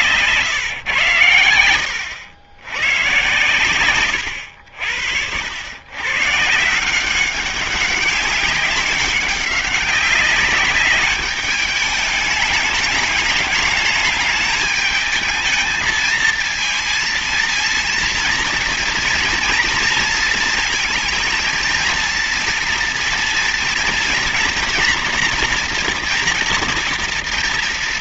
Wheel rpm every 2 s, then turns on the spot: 140, 110, 90, 140, 200, 200, 210, 210, 220, 230, 230, 230, 230, 230.
none